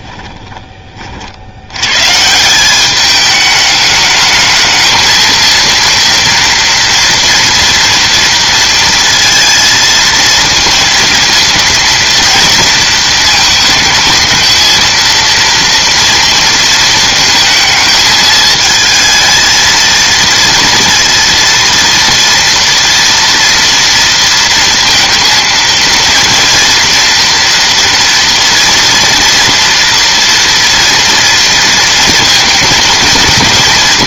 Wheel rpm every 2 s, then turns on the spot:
20, 180, 220, 230, 230, 230, 230, 220, 230, 220, 230, 230, 230, 230, 230, 230, 230.
none